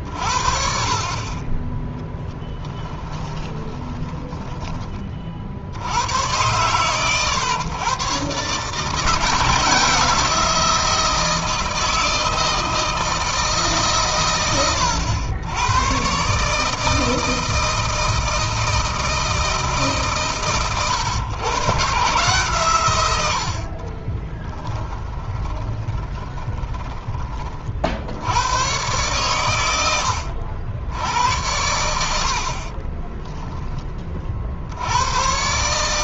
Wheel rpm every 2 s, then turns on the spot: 40, 10, 20, 100, 150, 170, 160, 100, 150, 160, 120, 120, 10, 20, 110, 90, 30, 80.
2-4 24-26 32-34